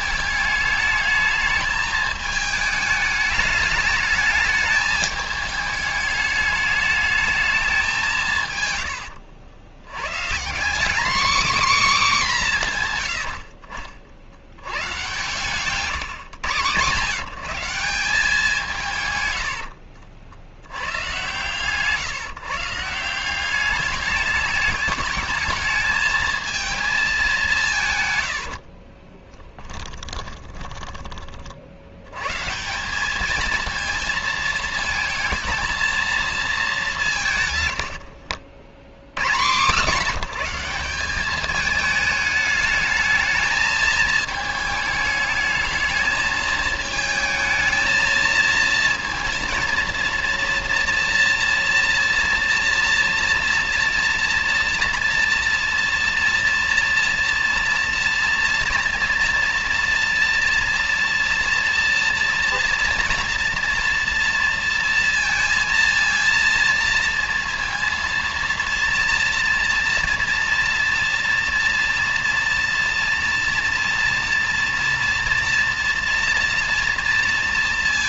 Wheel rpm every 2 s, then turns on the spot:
210, 210, 210, 210, 90, 240, 110, 120, 140, 150, 100, 160, 210, 220, 40, 10, 180, 220, 220, 80, 190, 210, 210, 220, 230, 240, 230, 230, 230, 230, 240, 240, 230, 230, 230, 230, 230, 230, 230.
8-10 28-32